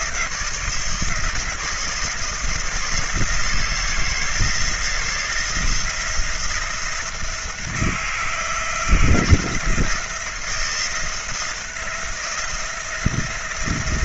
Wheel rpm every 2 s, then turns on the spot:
170, 160, 160, 170, 170, 170, 170.
none